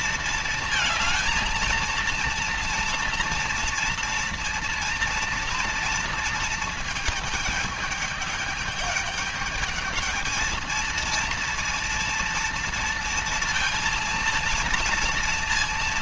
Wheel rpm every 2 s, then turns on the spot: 220, 230, 230, 220, 210, 230, 230, 230.
none